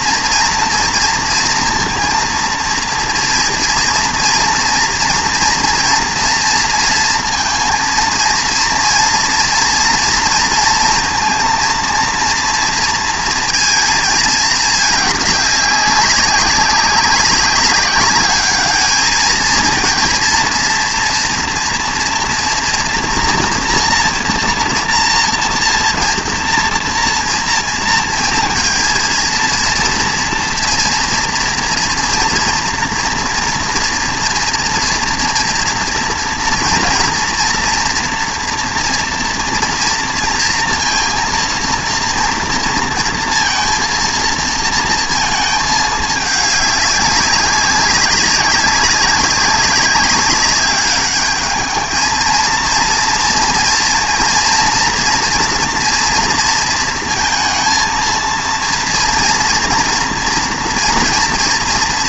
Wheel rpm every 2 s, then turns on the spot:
230, 230, 230, 230, 230, 230, 230, 210, 200, 210, 230, 230, 230, 230, 230, 230, 230, 230, 230, 240, 230, 230, 230, 200, 200, 200, 230, 230, 230, 230, 230.
none